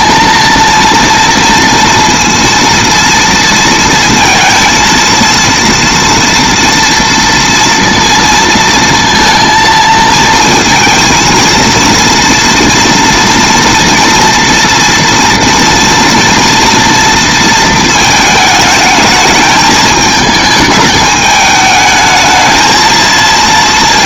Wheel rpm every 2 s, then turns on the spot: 230, 230, 230, 230, 230, 220, 230, 230, 230, 210, 210, 220.
none